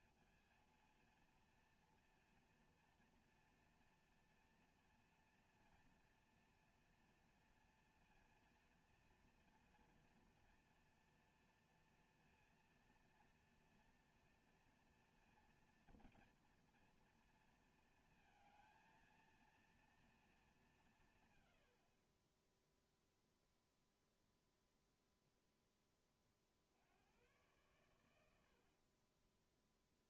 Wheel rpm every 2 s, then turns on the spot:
230, 240, 230, 230, 230, 230, 230, 230, 230, 220, 210, 10, 0, 30, 90.
none